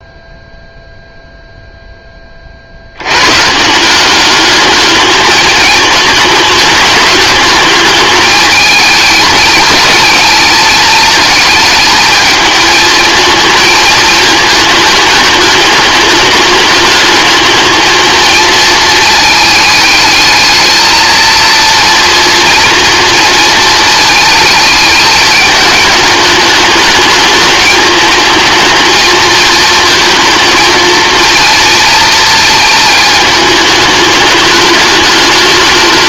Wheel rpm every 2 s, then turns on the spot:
0, 60, 210, 210, 220, 220, 220, 220, 210, 230, 220, 230, 220, 210, 220, 230, 220, 210.
none